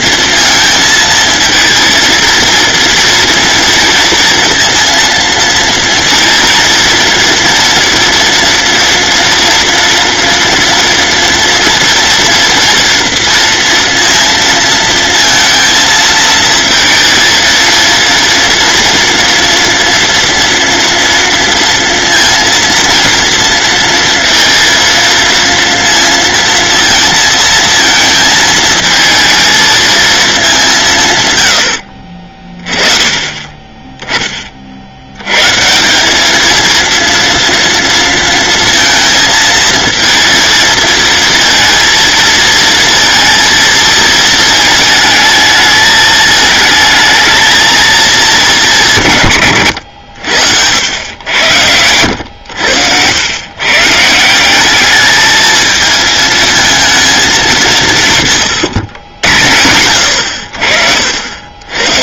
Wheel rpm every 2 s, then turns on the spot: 230, 230, 230, 230, 230, 230, 240, 230, 230, 240, 230, 230, 230, 230, 220, 150, 20, 90, 230, 230, 230, 230, 220, 220, 160, 100, 100, 210, 220, 100, 50.
none